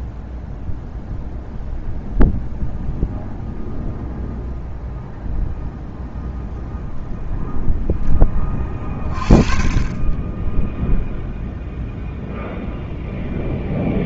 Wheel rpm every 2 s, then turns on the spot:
0, 0, 0, 0, 40, 0, 0.
none